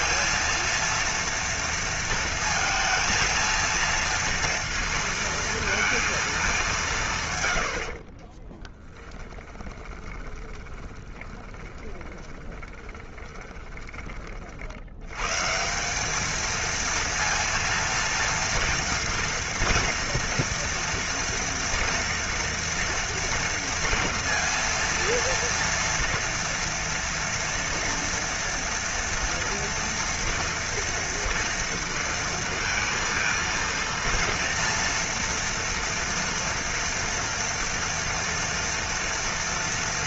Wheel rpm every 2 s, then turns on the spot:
230, 230, 230, 160, 10, 20, 20, 80, 230, 240, 230, 240, 230, 230, 230, 230, 230, 230, 230, 230.
8-14